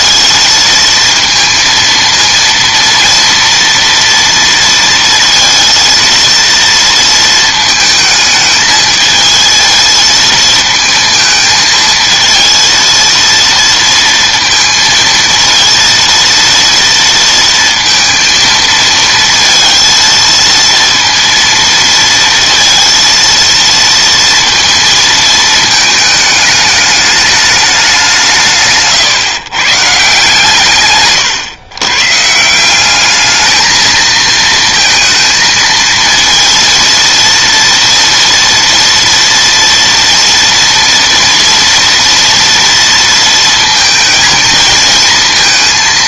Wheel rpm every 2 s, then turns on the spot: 230, 230, 230, 230, 220, 220, 230, 230, 230, 230, 230, 230, 230, 210, 150, 140, 180, 230, 230, 230, 230, 230, 230.
none